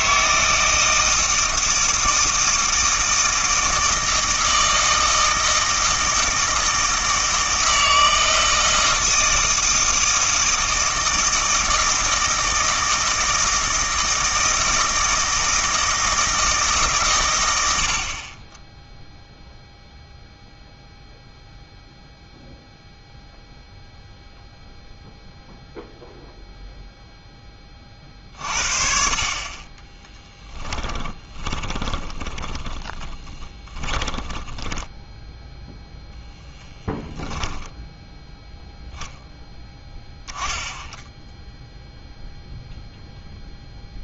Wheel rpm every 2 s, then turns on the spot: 160, 160, 160, 160, 160, 160, 160, 160, 160, 20, 0, 0, 0, 0, 50, 10, 20, 10, 0, 0, 10, 0.
30-36